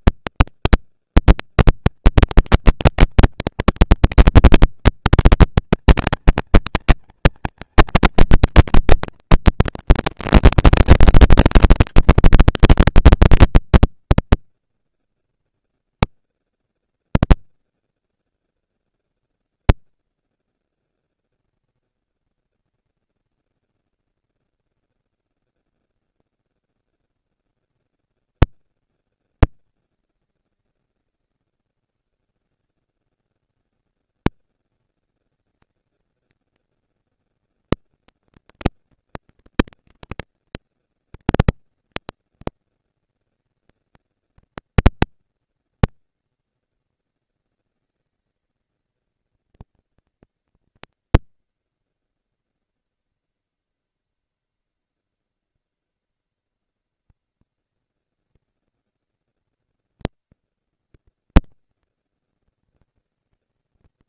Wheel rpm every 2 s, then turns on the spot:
120, 210, 230, 230, 220, 210, 220, 230, 200, 190, 230, 230, 230, 230, 210, 180, 110, 190, 230, 230, 230, 230, 230, 230, 230, 230, 230, 230, 230, 230, 230, 230.
none